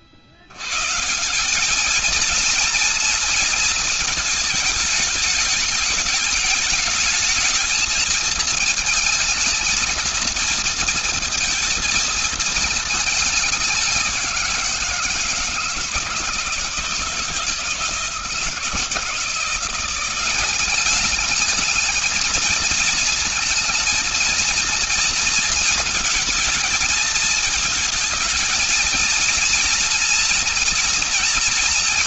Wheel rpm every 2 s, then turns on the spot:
110, 230, 220, 220, 220, 230, 220, 170, 170, 160, 200, 220, 230, 230, 230, 230.
none